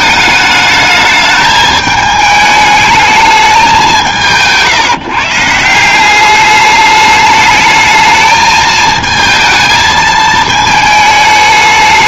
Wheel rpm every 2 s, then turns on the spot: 210, 210, 150, 210, 220, 220.
none